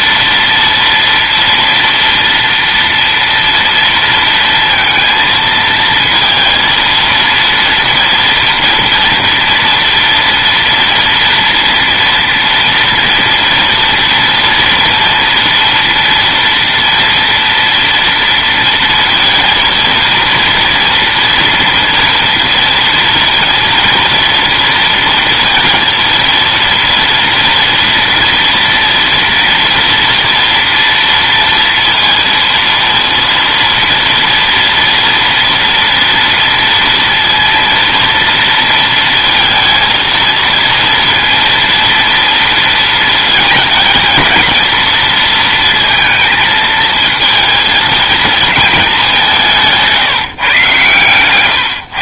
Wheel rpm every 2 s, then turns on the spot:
230, 230, 230, 230, 230, 240, 230, 230, 240, 230, 230, 230, 230, 230, 230, 230, 230, 230, 230, 230, 230, 230, 230, 220, 210, 130.
none